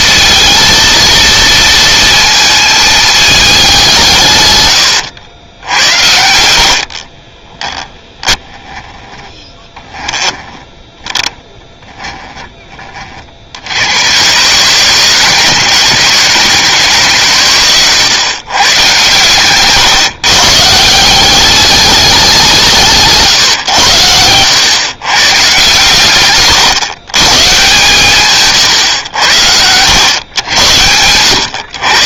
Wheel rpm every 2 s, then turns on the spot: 230, 220, 110, 60, 10, 10, 20, 140, 150, 130, 150, 160, 120, 130, 110, 90.
6-10 28-30